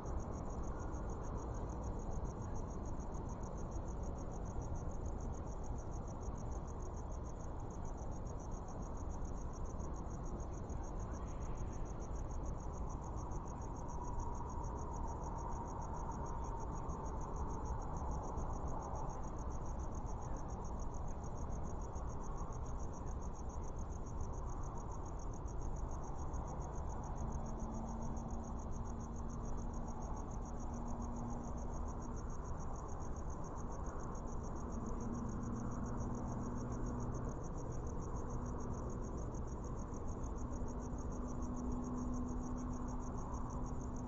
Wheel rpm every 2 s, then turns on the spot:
0, 0, 0, 0, 0, 0, 0, 0, 0, 0, 0, 0, 0, 0, 0, 0, 0, 0, 0, 0, 0, 0.
none